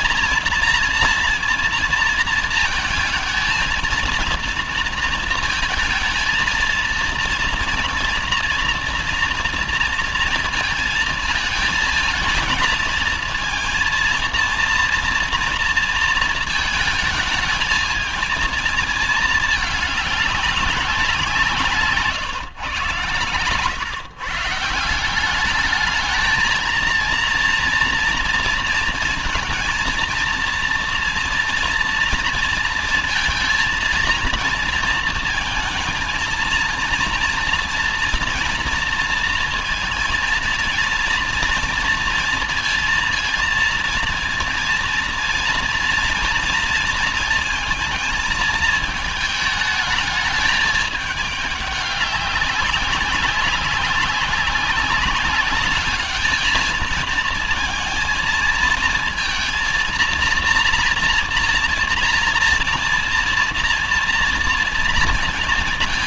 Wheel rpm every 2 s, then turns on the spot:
230, 220, 230, 230, 230, 220, 220, 230, 220, 220, 180, 120, 170, 230, 230, 230, 230, 230, 230, 230, 230, 230, 230, 230, 220, 210, 190, 200, 230, 220, 240, 230, 230.
none